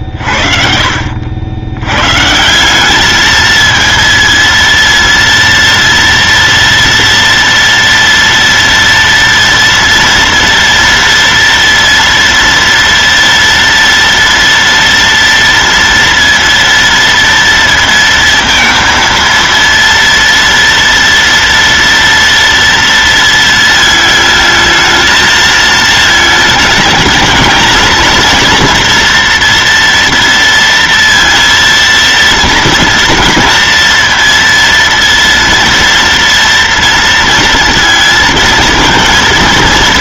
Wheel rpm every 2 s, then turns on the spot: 50, 130, 230, 230, 230, 230, 230, 230, 230, 230, 230, 230, 220, 220, 230, 230, 230, 230, 230, 230.
none